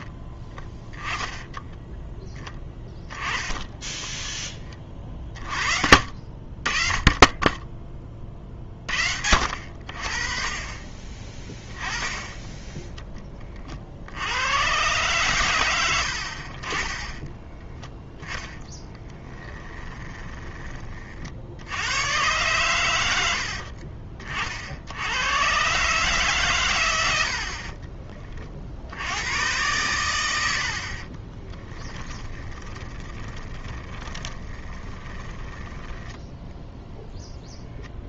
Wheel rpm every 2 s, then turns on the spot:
10, 20, 20, 50, 30, 40, 10, 110, 40, 10, 20, 110, 50, 120, 60, 70, 20, 20, 10.
18-20 30-38